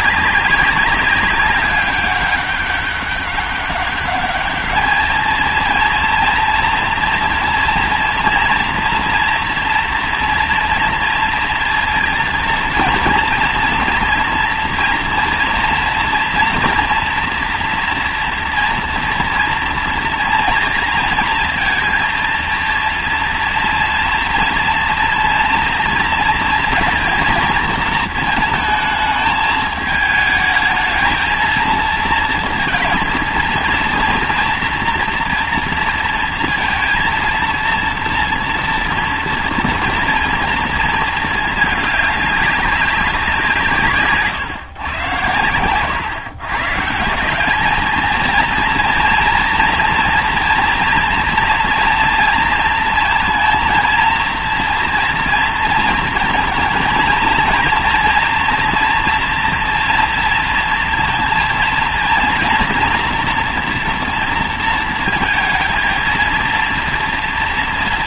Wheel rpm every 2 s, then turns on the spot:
200, 200, 210, 230, 240, 230, 230, 230, 240, 230, 230, 230, 230, 230, 220, 220, 230, 240, 230, 230, 230, 200, 120, 130, 230, 230, 230, 230, 230, 230, 230, 240, 230, 240.
none